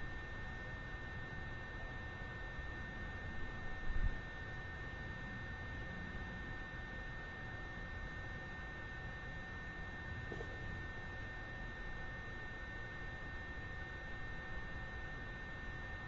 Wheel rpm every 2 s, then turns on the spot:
0, 0, 0, 0, 0, 0, 0, 0.
none